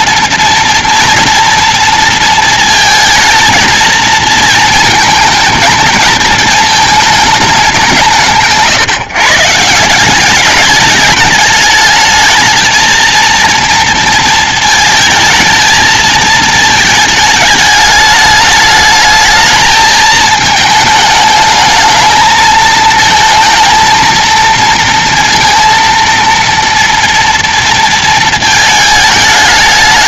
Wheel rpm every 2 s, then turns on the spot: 240, 230, 230, 220, 150, 210, 220, 220, 220, 220, 220, 220, 230, 230, 220.
none